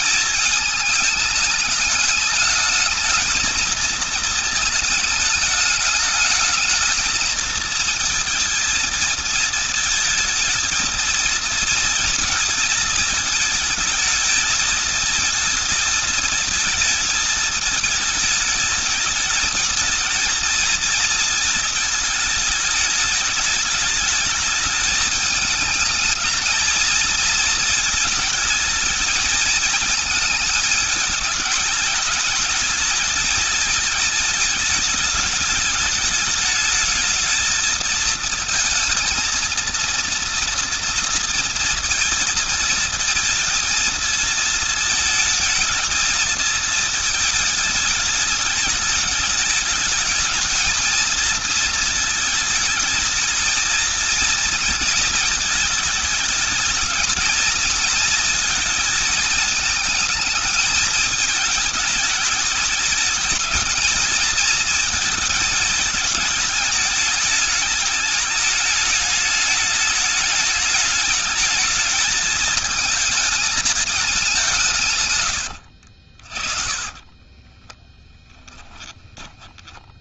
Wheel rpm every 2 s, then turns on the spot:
220, 220, 220, 220, 230, 220, 220, 220, 220, 220, 230, 210, 210, 220, 220, 220, 220, 210, 220, 220, 230, 230, 220, 220, 210, 220, 220, 220, 220, 220, 210, 220, 220, 210, 210, 210, 220, 140, 30, 20.
76-78